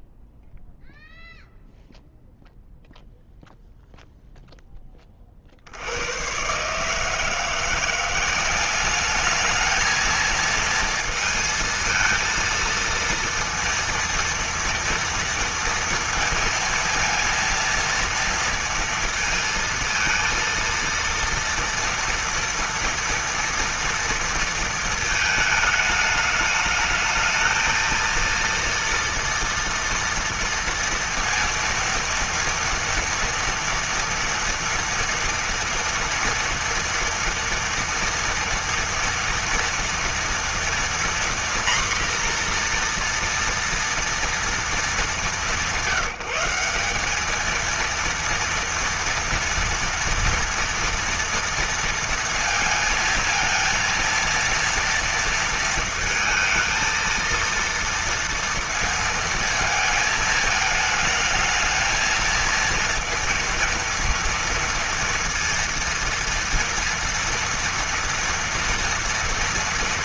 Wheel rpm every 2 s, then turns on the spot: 0, 0, 10, 130, 190, 230, 230, 230, 230, 230, 230, 230, 230, 210, 230, 230, 230, 230, 240, 230, 240, 240, 220, 190, 230, 230, 230, 230, 230, 230, 220, 230, 230, 230, 230.
none